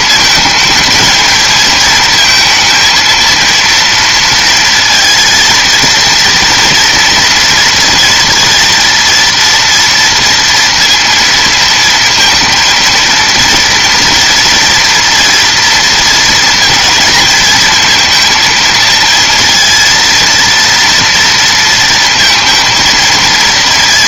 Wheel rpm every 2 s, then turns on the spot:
220, 230, 230, 230, 230, 230, 230, 230, 230, 230, 230, 230.
none